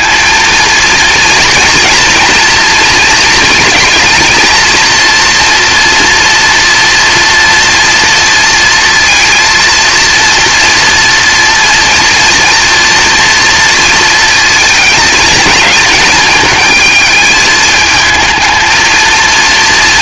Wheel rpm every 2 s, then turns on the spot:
230, 220, 230, 230, 230, 230, 230, 230, 220, 220.
none